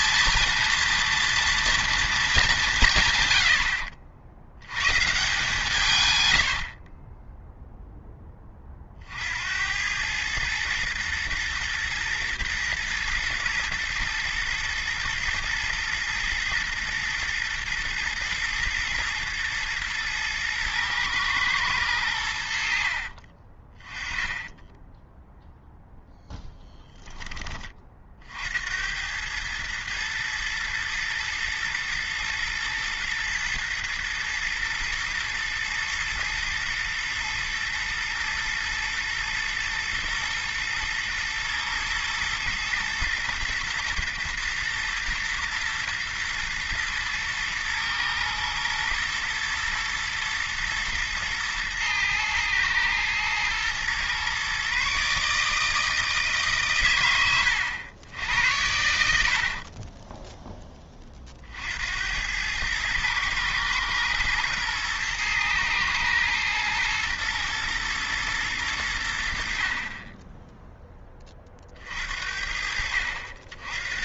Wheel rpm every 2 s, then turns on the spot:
240, 140, 110, 50, 50, 110, 120, 110, 120, 120, 110, 50, 10, 10, 80, 110, 110, 110, 120, 110, 120, 120, 110, 110, 110, 120, 110, 140, 120, 80, 20, 110, 110, 110, 90, 10, 70.
6-8 22-26